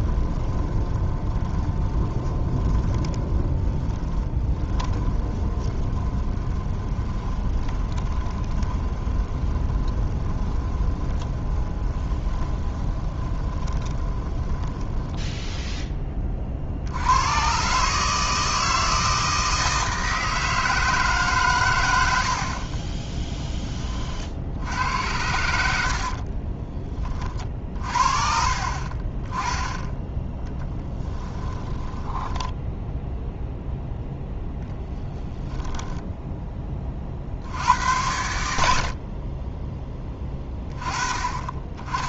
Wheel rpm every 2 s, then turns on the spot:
20, 20, 20, 10, 20, 20, 20, 10, 60, 160, 160, 30, 80, 40, 40, 10, 10, 0, 20, 70, 20.
0-16 22-24 30-34